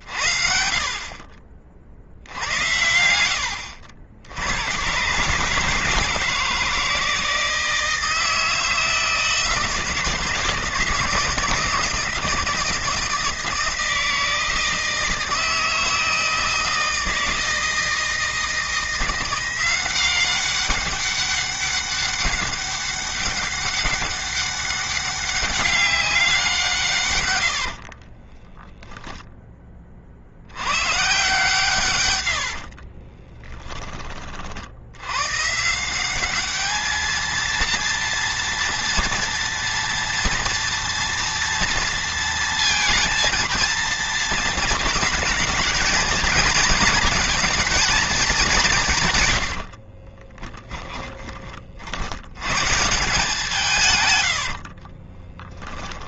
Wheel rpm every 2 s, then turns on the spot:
40, 80, 110, 160, 160, 150, 160, 160, 160, 170, 200, 200, 200, 150, 10, 120, 50, 80, 220, 230, 230, 220, 220, 220, 160, 10, 150, 60.
32-34 50-52 54-56